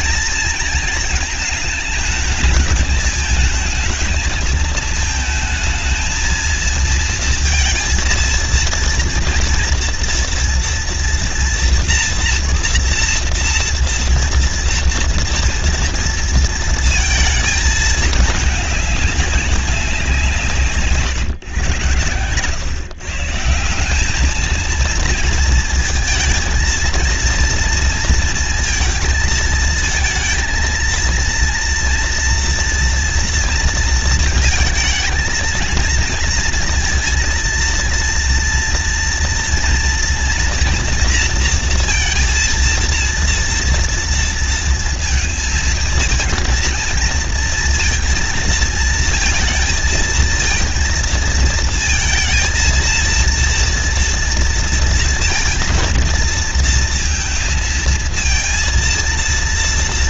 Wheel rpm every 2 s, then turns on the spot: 230, 220, 220, 230, 230, 230, 230, 230, 230, 200, 140, 130, 220, 230, 230, 230, 230, 220, 230, 240, 230, 230, 230, 220, 230, 230, 230, 230, 230, 230.
none